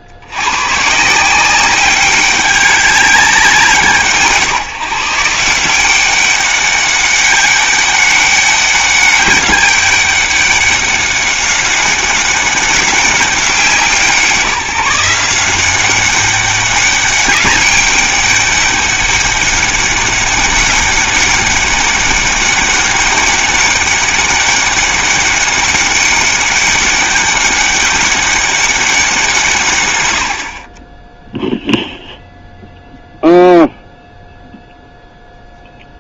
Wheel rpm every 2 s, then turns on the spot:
100, 200, 150, 200, 200, 200, 200, 170, 200, 200, 190, 200, 200, 200, 200, 40, 0, 0.
none